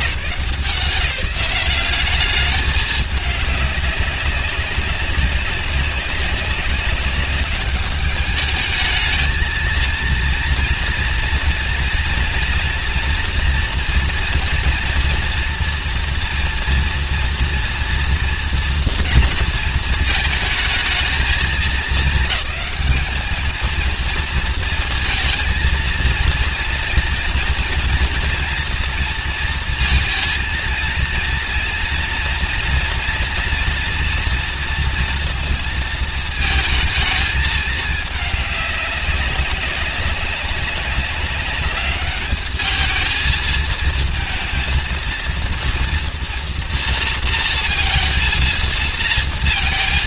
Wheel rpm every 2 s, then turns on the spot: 180, 210, 190, 200, 220, 230, 230, 230, 240, 240, 220, 220, 230, 230, 230, 230, 240, 230, 220, 200, 200, 210, 230, 230, 230.
none